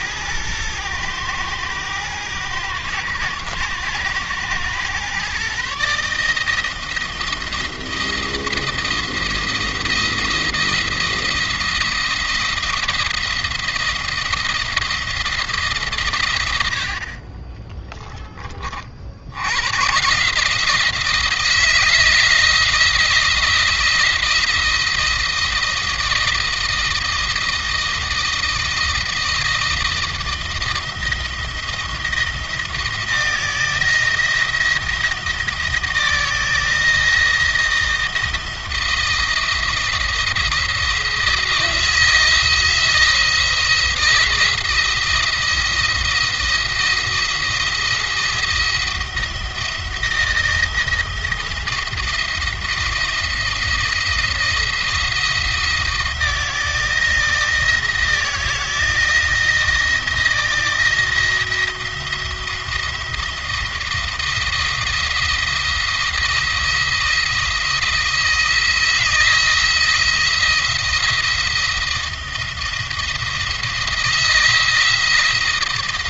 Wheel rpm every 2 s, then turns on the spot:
110, 120, 120, 160, 170, 170, 170, 170, 70, 50, 160, 170, 170, 160, 170, 170, 170, 170, 160, 160, 170, 160, 170, 170, 170, 160, 170, 170, 160, 160, 170, 170, 170, 170, 160, 170, 170, 160.
none